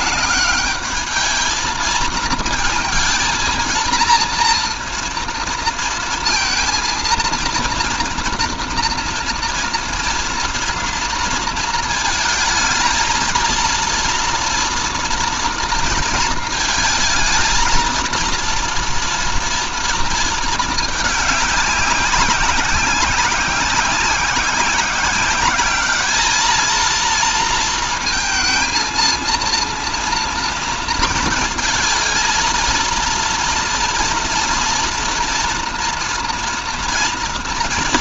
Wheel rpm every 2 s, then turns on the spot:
210, 230, 230, 230, 230, 240, 220, 230, 220, 230, 220, 190, 190, 220, 230, 230, 230, 230, 240.
none